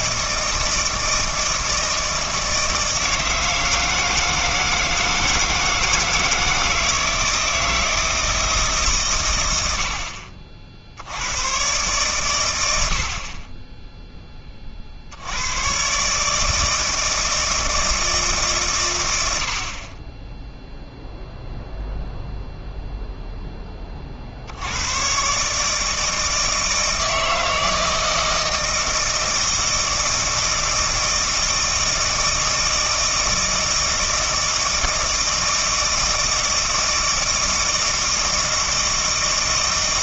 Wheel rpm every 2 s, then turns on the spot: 160, 160, 160, 160, 150, 60, 90, 30, 160, 140, 0, 0, 100, 160, 160, 160, 160, 160, 160, 160.
none